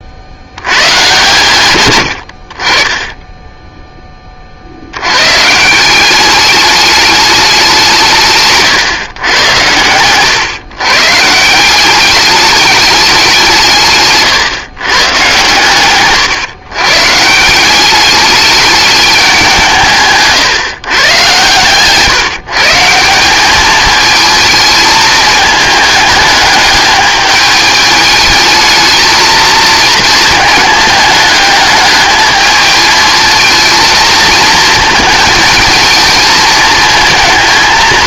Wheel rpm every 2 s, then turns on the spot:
90, 30, 60, 200, 140, 130, 210, 130, 130, 210, 130, 160, 220, 210, 220, 220, 220, 220, 220.
none